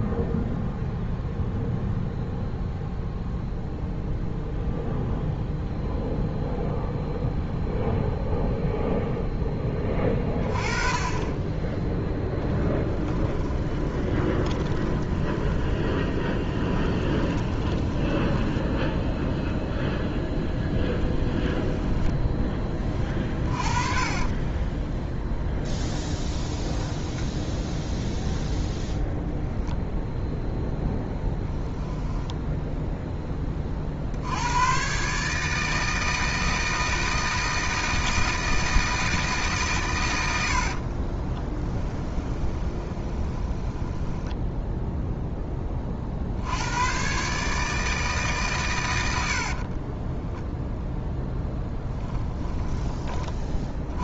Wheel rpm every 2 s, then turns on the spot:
0, 0, 0, 0, 0, 20, 10, 20, 20, 10, 10, 20, 10, 10, 0, 0, 0, 120, 160, 160, 50, 20, 0, 110, 120, 0, 10.
12-20 22-28 40-44 52-54